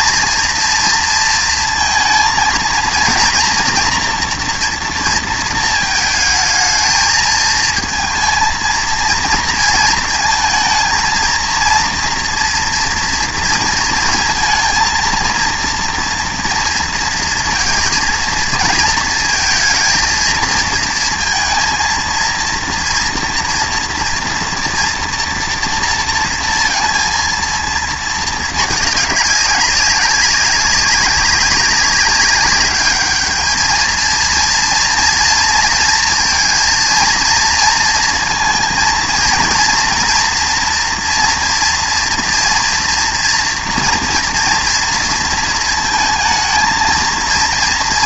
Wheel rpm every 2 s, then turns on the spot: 230, 230, 230, 220, 230, 230, 230, 230, 230, 230, 230, 230, 240, 230, 210, 190, 200, 230, 230, 230, 230, 230, 240, 230.
none